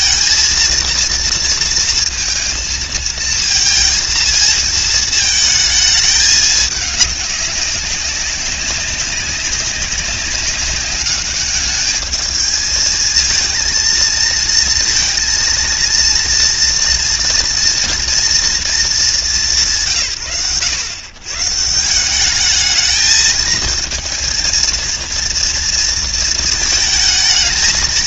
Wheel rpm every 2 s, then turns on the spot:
230, 230, 220, 210, 190, 200, 220, 230, 230, 230, 90, 210, 230, 220.
none